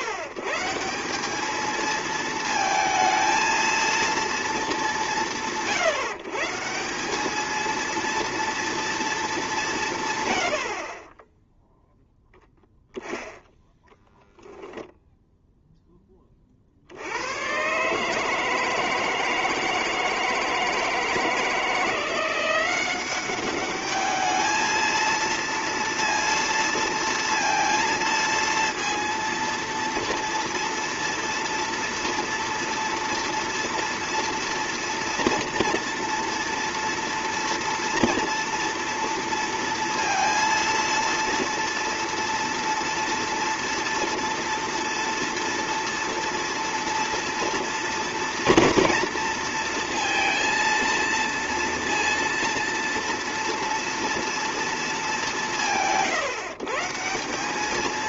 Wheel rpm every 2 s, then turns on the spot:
140, 220, 180, 170, 230, 80, 0, 0, 50, 160, 160, 180, 220, 230, 230, 230, 230, 230, 230, 230, 230, 230, 230, 230, 230, 230, 230, 230, 140.
none